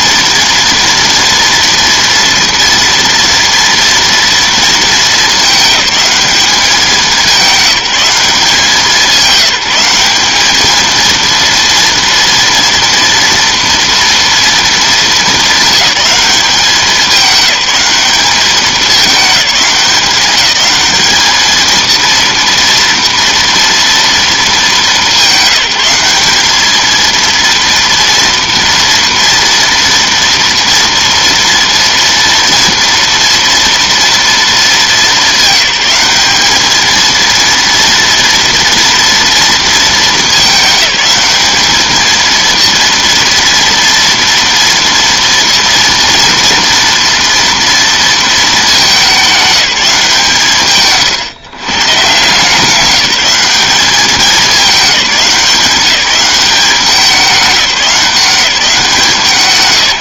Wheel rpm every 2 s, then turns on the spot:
230, 230, 230, 200, 190, 210, 230, 230, 200, 200, 190, 230, 210, 210, 230, 230, 230, 210, 210, 230, 210, 230, 230, 230, 210, 140, 170, 190, 190, 180.
none